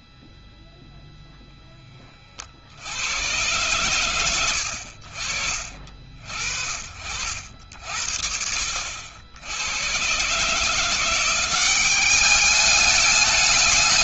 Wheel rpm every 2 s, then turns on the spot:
0, 40, 70, 50, 60, 160, 200.
none